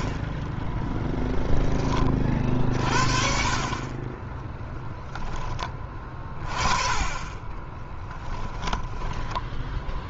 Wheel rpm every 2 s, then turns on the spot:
0, 50, 10, 30, 10.
8-10